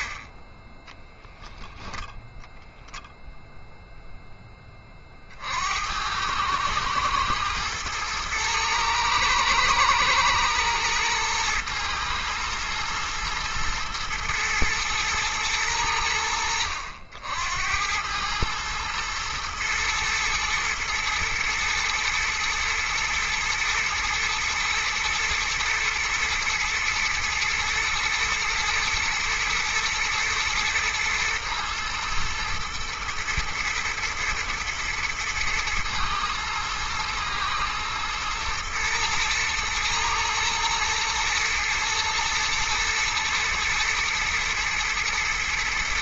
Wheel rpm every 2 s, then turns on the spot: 10, 0, 20, 110, 110, 120, 120, 120, 70, 110, 120, 110, 110, 120, 120, 120, 110, 120, 120, 110, 110, 120, 110.
0-2